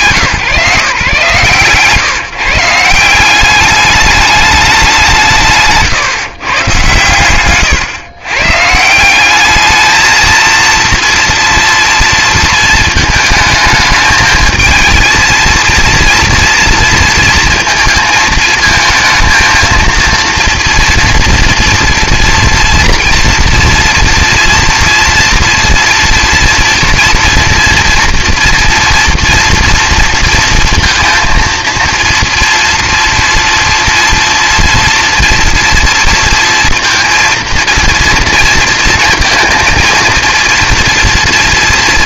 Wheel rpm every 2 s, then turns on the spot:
140, 160, 200, 140, 140, 230, 230, 220, 230, 220, 230, 230, 230, 230, 230, 230, 230, 230, 230, 230, 230.
none